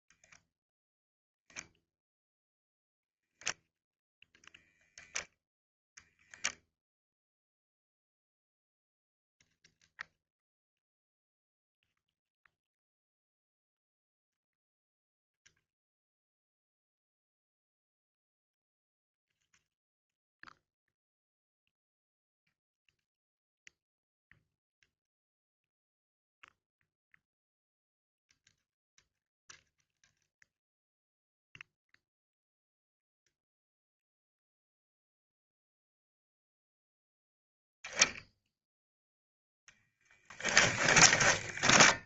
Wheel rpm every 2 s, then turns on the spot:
0, 0, 0, 0, 0, 0, 0, 0, 0, 0, 0, 0, 0, 0, 0, 0, 0, 0, 0, 0, 20.
40-42